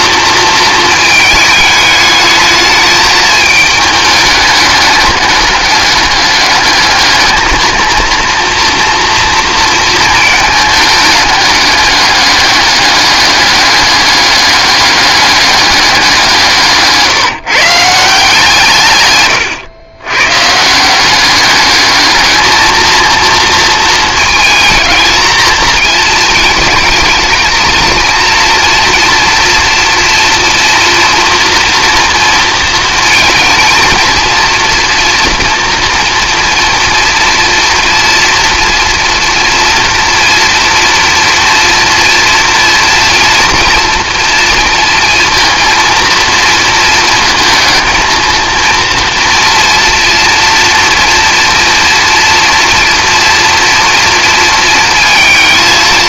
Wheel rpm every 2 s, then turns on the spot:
220, 220, 210, 210, 230, 210, 200, 200, 160, 140, 170, 230, 220, 220, 230, 230, 230, 230, 230, 230, 230, 230, 230, 230, 230, 230, 230, 220.
none